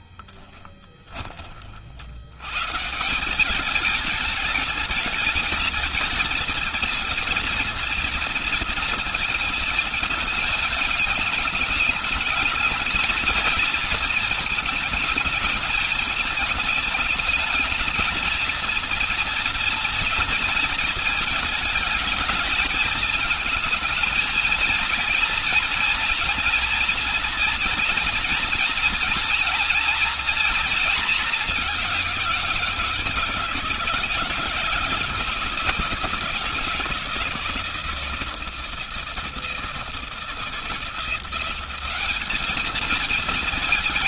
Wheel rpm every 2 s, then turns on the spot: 20, 110, 210, 220, 230, 220, 220, 220, 220, 230, 230, 210, 220, 240, 230, 230, 170, 160, 160, 160, 160, 210.
0-2